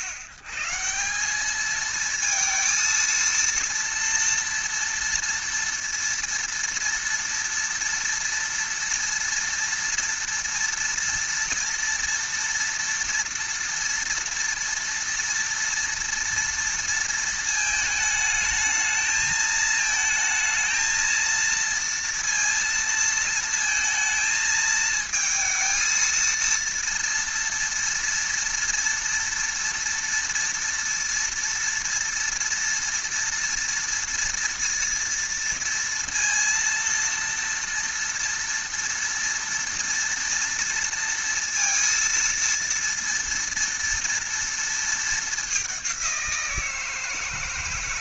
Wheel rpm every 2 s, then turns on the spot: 120, 230, 230, 230, 230, 230, 230, 230, 230, 220, 220, 230, 220, 230, 230, 230, 230, 230, 230, 230, 230, 230, 230, 170.
none